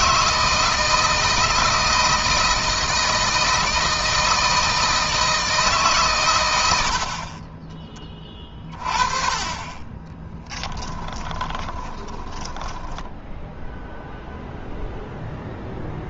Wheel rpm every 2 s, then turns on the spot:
160, 160, 160, 60, 30, 10, 10, 0.
10-14